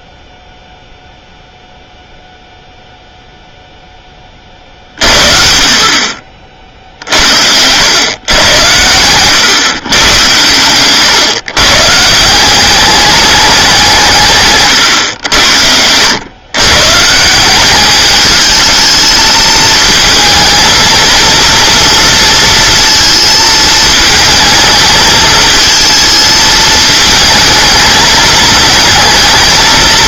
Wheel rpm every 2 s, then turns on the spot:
0, 0, 50, 50, 100, 130, 200, 120, 130, 220, 230, 230, 220, 220, 220.
6-8